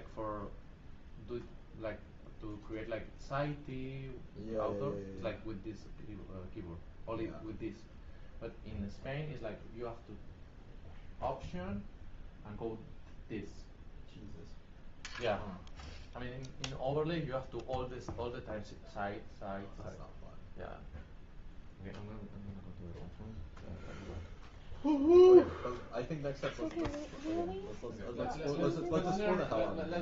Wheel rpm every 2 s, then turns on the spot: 0, 0, 0, 0, 0, 0, 0, 0, 0, 0, 0, 0, 0, 0, 0.
none